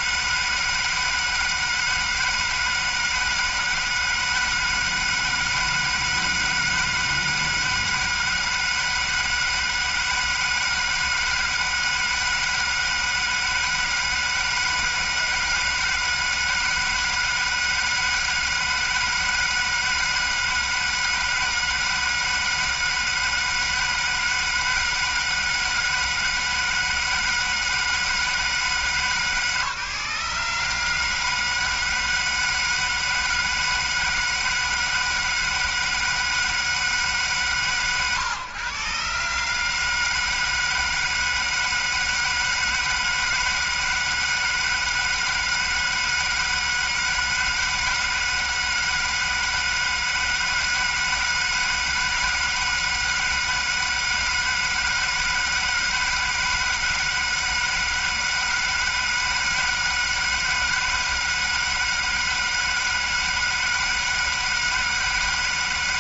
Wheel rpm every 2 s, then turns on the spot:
160, 160, 160, 160, 160, 160, 160, 160, 160, 160, 160, 160, 160, 160, 150, 150, 160, 160, 150, 130, 160, 160, 160, 160, 160, 160, 160, 160, 160, 160, 160, 160, 160.
none